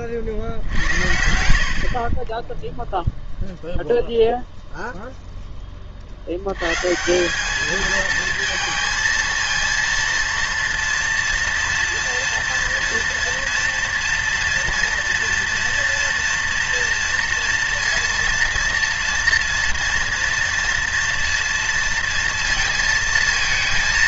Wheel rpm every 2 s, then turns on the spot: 70, 0, 0, 110, 230, 230, 230, 230, 230, 230, 230, 230.
none